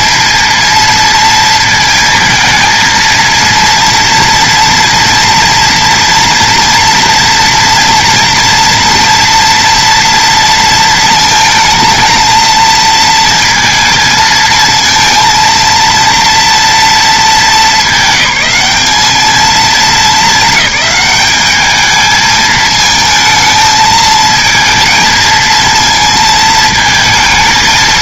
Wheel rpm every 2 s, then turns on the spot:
230, 220, 230, 240, 230, 230, 230, 230, 240, 210, 210, 220, 230, 220.
none